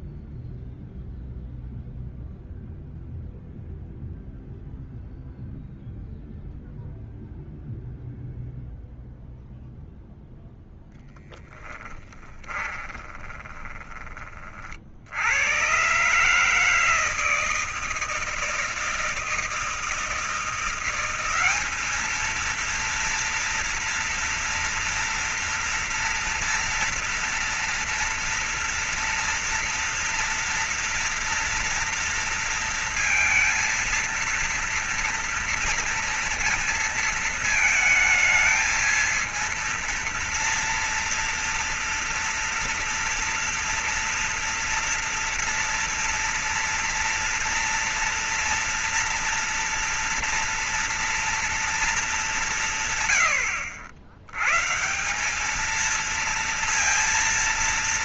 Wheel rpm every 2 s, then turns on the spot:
0, 0, 0, 0, 0, 0, 10, 30, 140, 160, 160, 210, 230, 230, 230, 230, 230, 230, 230, 220, 230, 240, 230, 230, 230, 230, 190, 100, 230.
12-14